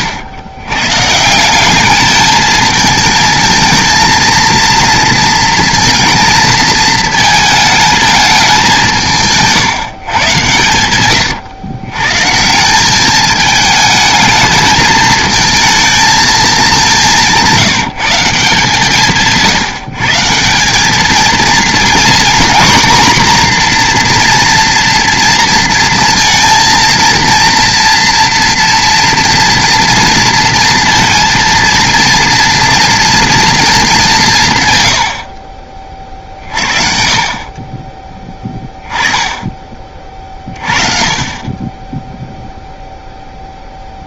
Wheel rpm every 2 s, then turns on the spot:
130, 220, 230, 220, 170, 110, 200, 220, 200, 160, 210, 240, 240, 230, 230, 230, 230, 90, 50, 20, 40, 0.
10-12